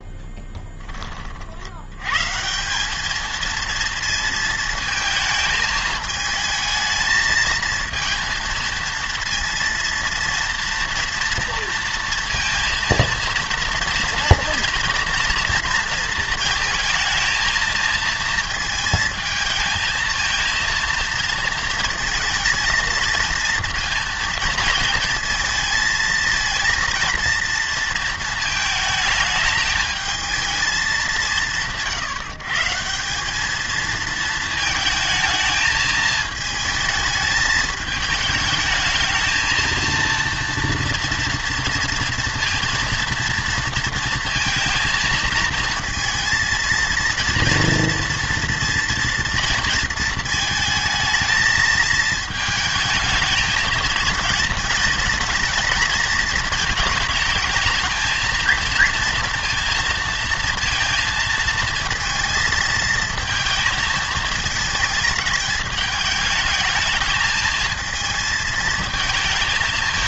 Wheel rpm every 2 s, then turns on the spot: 10, 180, 220, 220, 230, 230, 230, 230, 230, 230, 230, 220, 230, 230, 220, 220, 170, 220, 220, 220, 230, 230, 230, 230, 230, 220, 220, 220, 220, 230, 230, 220, 220, 220, 220.
none